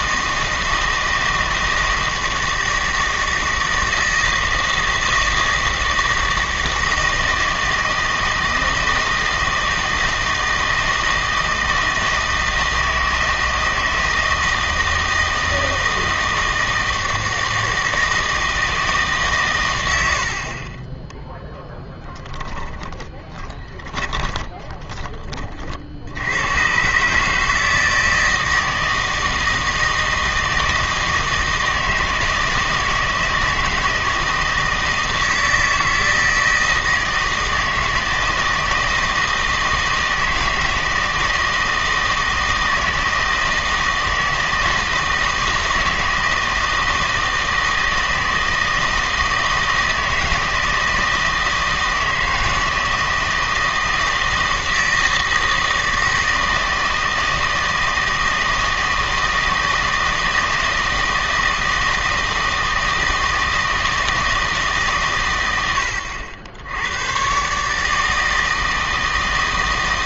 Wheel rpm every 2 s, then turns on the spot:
160, 160, 160, 160, 160, 160, 160, 160, 160, 160, 40, 20, 20, 120, 160, 160, 160, 160, 160, 160, 160, 160, 160, 160, 160, 160, 160, 160, 160, 160, 160, 160, 150, 90, 160.
22-26